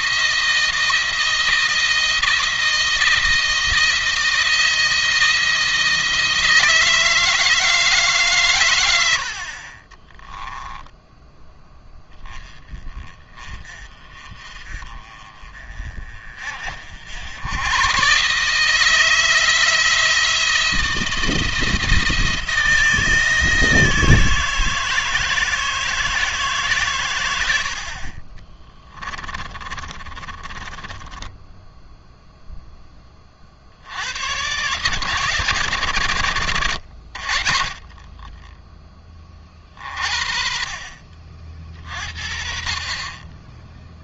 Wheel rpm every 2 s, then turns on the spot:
170, 170, 170, 160, 110, 10, 20, 40, 50, 150, 170, 160, 160, 150, 30, 30, 10, 120, 100, 20, 40, 30.
10-12 28-32